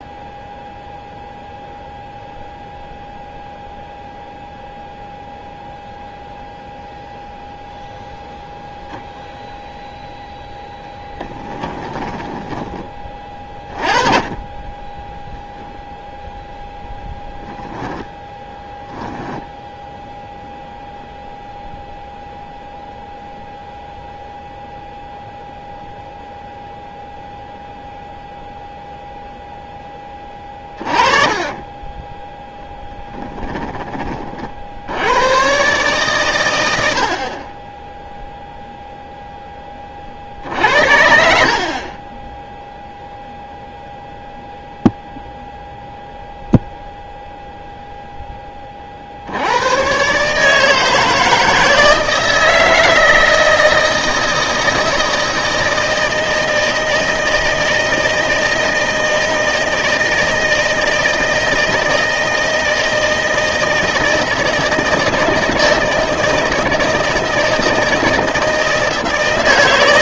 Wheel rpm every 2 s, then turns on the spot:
0, 0, 0, 0, 0, 0, 10, 10, 0, 10, 0, 0, 0, 0, 0, 20, 10, 60, 90, 0, 60, 0, 0, 0, 20, 150, 160, 160, 160, 160, 160, 160, 160, 160, 160.
18-20 32-34